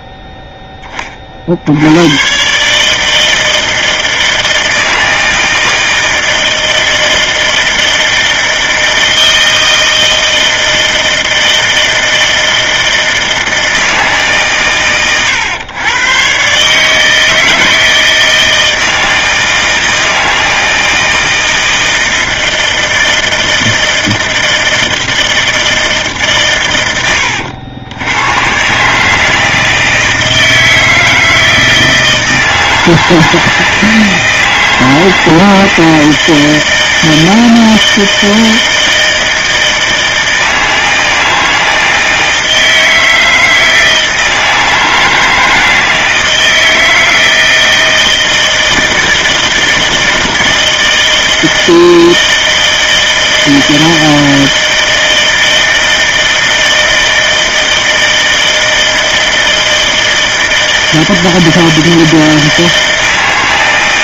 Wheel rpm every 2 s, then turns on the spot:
20, 150, 160, 160, 160, 160, 160, 120, 150, 160, 160, 160, 160, 110, 150, 160, 160, 160, 160, 160, 160, 160, 160, 160, 160, 160, 160, 160, 160, 160, 160, 160.
none